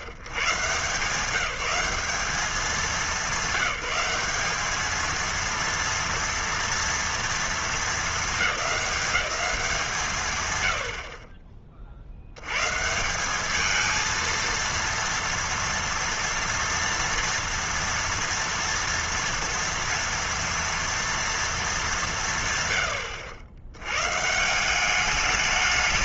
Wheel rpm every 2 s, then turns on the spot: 130, 200, 210, 230, 210, 140, 80, 230, 230, 230, 230, 150, 150.
none